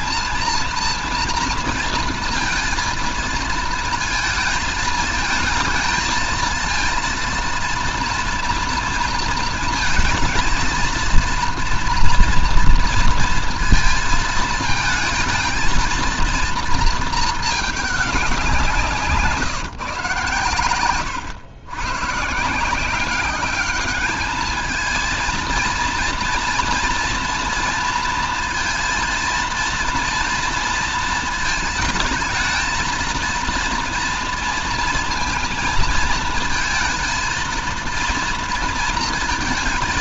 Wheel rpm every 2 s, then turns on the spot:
230, 230, 220, 230, 230, 230, 230, 220, 230, 160, 100, 180, 220, 230, 230, 230, 230, 230, 220, 230.
18-20